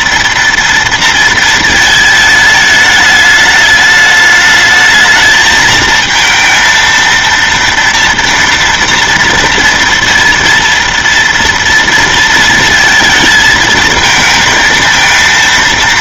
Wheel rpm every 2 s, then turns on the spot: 230, 220, 220, 230, 230, 230, 230, 220.
none